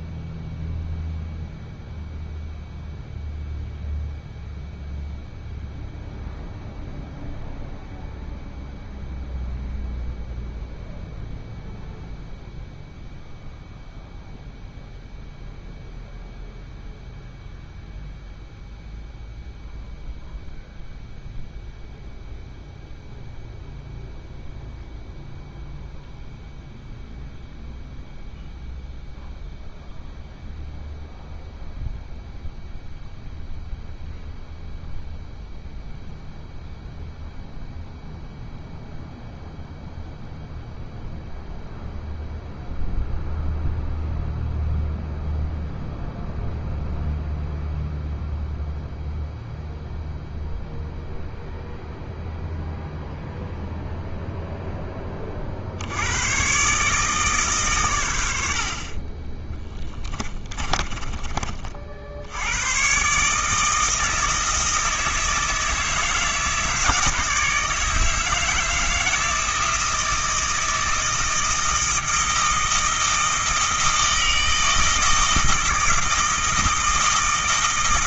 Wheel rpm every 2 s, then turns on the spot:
0, 0, 0, 0, 0, 0, 0, 0, 0, 0, 0, 0, 0, 0, 0, 0, 0, 0, 0, 0, 0, 0, 0, 0, 0, 0, 0, 0, 130, 60, 20, 100, 160, 160, 160, 160, 160, 160, 160.
60-62